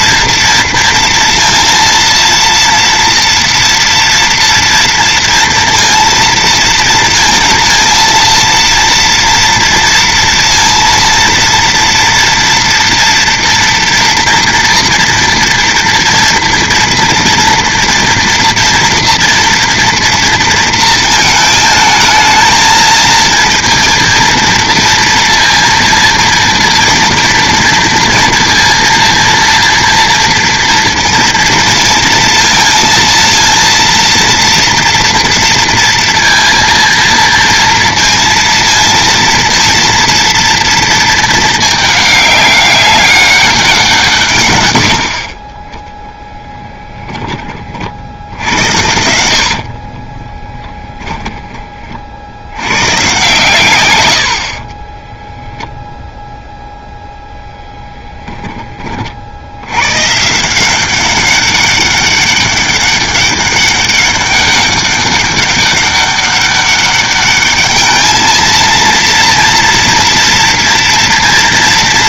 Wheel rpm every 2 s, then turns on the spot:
230, 230, 230, 230, 230, 230, 230, 240, 230, 230, 230, 220, 230, 230, 230, 240, 230, 230, 230, 230, 230, 200, 110, 20, 90, 10, 110, 30, 0, 30, 180, 200, 200, 200, 230, 230.
46-52 54-56